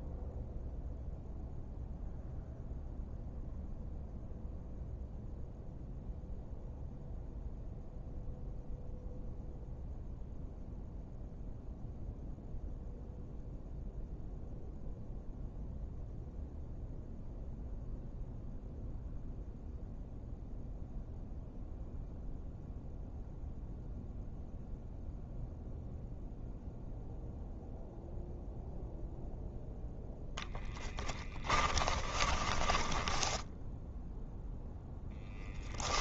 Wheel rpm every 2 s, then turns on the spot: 0, 0, 0, 0, 0, 0, 0, 0, 0, 0, 0, 0, 0, 0, 0, 10, 10, 0.
30-34